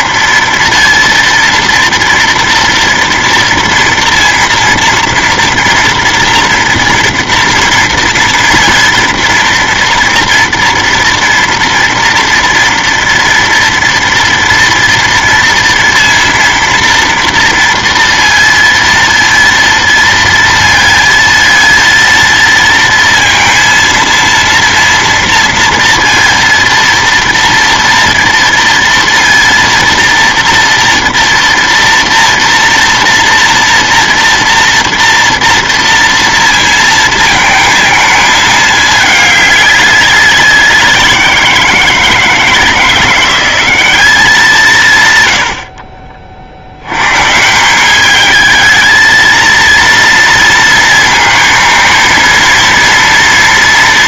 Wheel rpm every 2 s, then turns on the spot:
230, 240, 230, 230, 230, 230, 230, 230, 230, 230, 230, 230, 230, 230, 230, 230, 230, 230, 230, 220, 190, 160, 190, 50, 210, 230, 230.
none